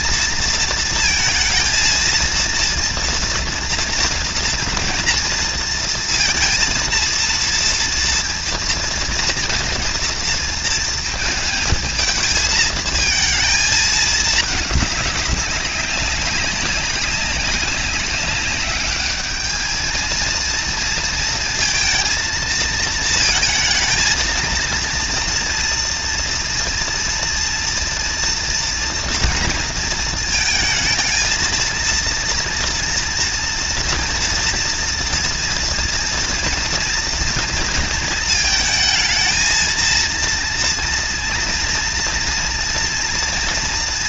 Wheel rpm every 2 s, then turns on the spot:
220, 230, 230, 230, 230, 230, 220, 210, 200, 200, 230, 230, 230, 230, 230, 220, 230, 230, 230, 220, 230, 230.
none